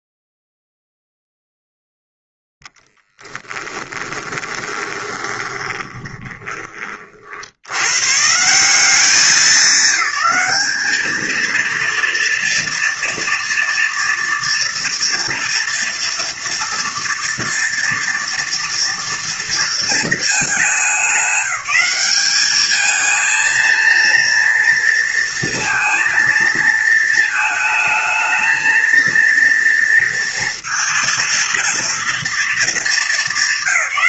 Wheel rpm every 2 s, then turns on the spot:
0, 10, 20, 30, 180, 210, 230, 230, 230, 230, 210, 210, 230, 230, 230, 230, 230.
2-6